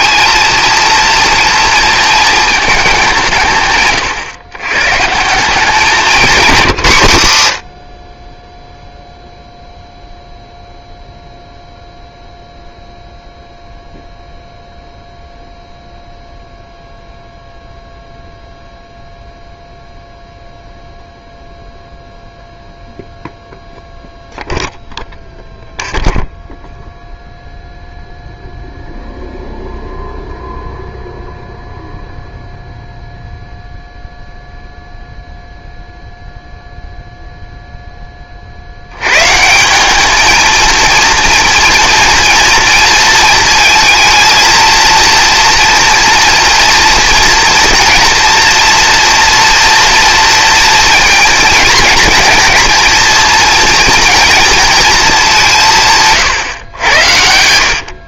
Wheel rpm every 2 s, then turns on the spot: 220, 120, 160, 10, 0, 0, 0, 0, 0, 0, 0, 0, 0, 0, 0, 0, 0, 0, 0, 40, 220, 230, 230, 230, 240, 230, 230, 230, 130.
4-6 56-58